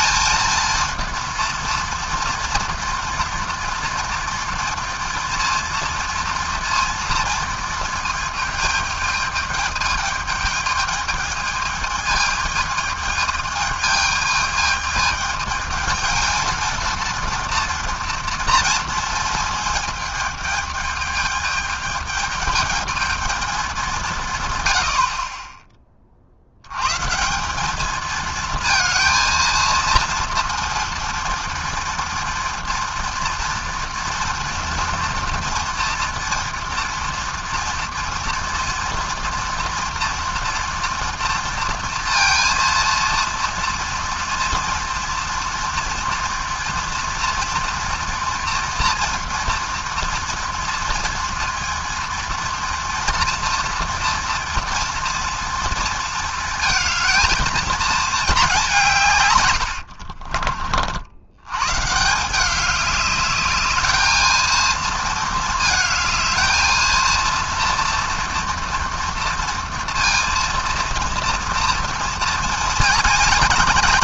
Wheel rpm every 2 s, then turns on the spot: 220, 230, 230, 230, 220, 210, 220, 220, 230, 230, 210, 210, 110, 90, 220, 230, 240, 230, 230, 230, 230, 230, 230, 240, 230, 230, 230, 230, 230, 200, 50, 200, 220, 220, 230, 230, 230.
none